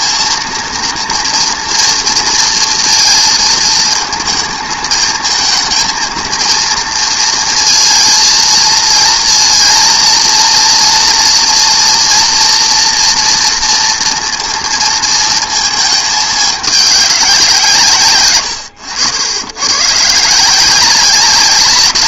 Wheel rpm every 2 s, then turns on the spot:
230, 230, 220, 230, 230, 230, 230, 230, 210, 100, 170.
none